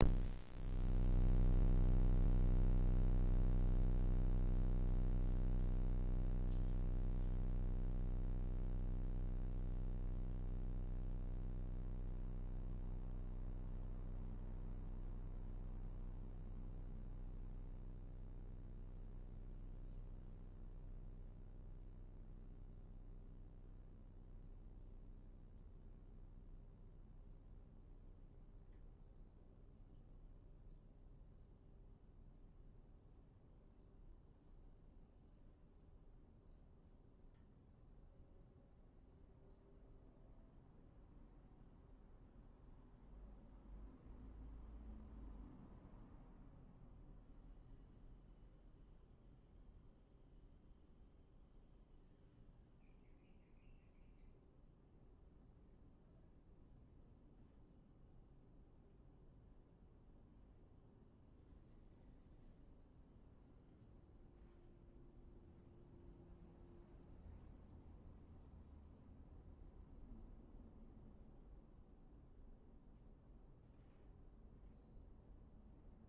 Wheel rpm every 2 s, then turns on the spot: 0, 0, 0, 0, 0, 0, 0, 0, 0, 0, 0, 0, 0, 0, 0, 0, 0, 0, 0, 0, 0, 0, 0, 0, 0, 0, 0, 0, 0, 0, 0, 0, 0, 0, 0, 0, 0, 0.
none